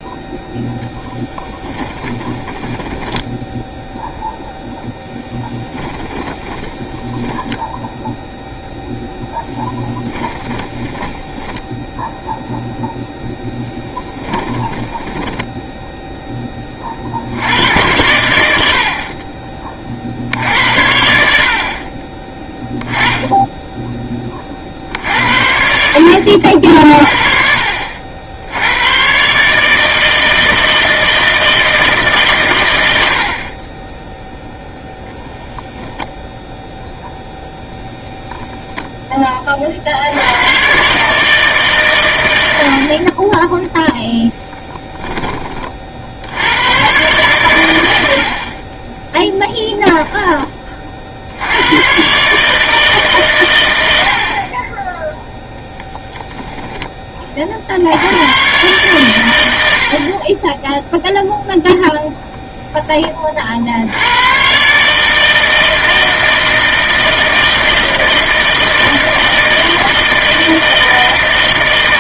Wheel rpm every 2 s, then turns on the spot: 10, 20, 10, 10, 0, 10, 0, 20, 40, 60, 80, 10, 60, 50, 110, 160, 100, 0, 0, 10, 140, 50, 10, 110, 30, 30, 150, 10, 10, 120, 10, 20, 150, 160, 160, 160.
2-4 10-12 14-16